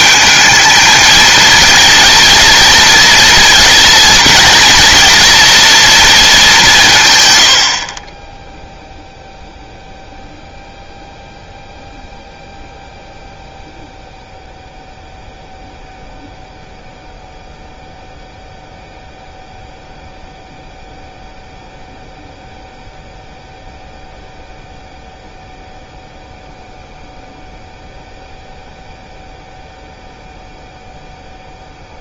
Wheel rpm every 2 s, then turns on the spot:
220, 230, 230, 180, 0, 0, 0, 0, 0, 0, 0, 0, 0, 0, 0, 0.
none